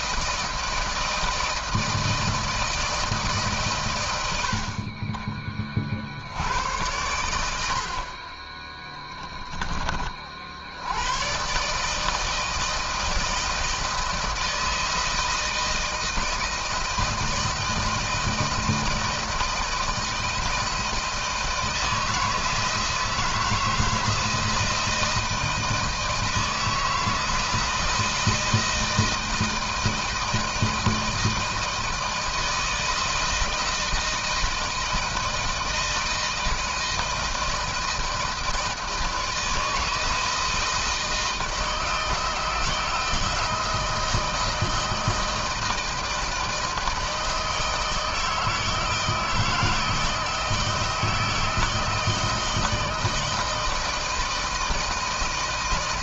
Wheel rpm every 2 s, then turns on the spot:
160, 160, 90, 80, 30, 50, 160, 160, 160, 160, 160, 160, 170, 160, 160, 160, 160, 160, 160, 160, 160, 160, 160, 160, 160, 160, 160, 160.
none